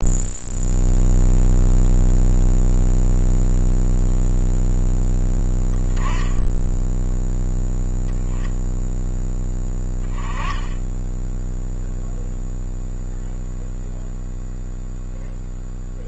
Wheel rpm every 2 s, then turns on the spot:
0, 0, 0, 10, 0, 10, 0, 0.
none